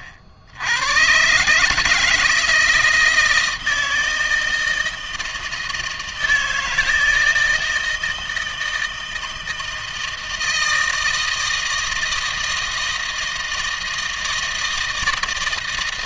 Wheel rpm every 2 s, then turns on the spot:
80, 160, 160, 160, 160, 160, 160, 160.
none